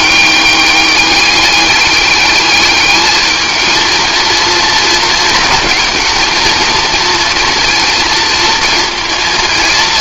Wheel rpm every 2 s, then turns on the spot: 200, 210, 230, 230, 230.
none